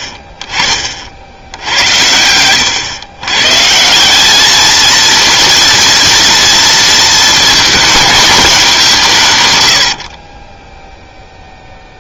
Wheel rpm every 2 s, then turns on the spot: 50, 100, 220, 230, 200, 20.
10-12